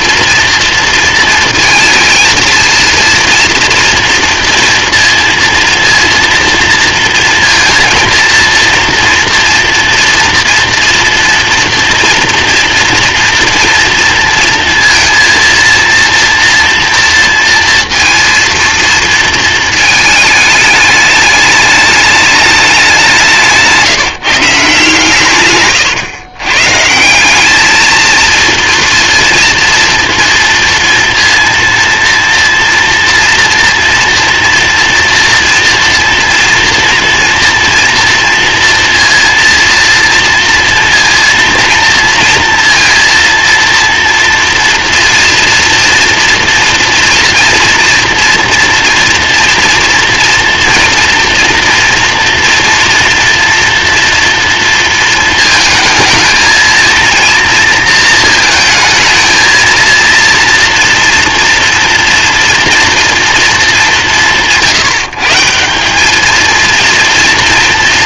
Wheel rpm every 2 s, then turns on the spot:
230, 230, 230, 230, 230, 240, 230, 230, 230, 230, 210, 210, 160, 120, 230, 230, 230, 230, 240, 230, 230, 230, 230, 230, 230, 230, 240, 230, 220, 230, 240, 230, 170, 220.
none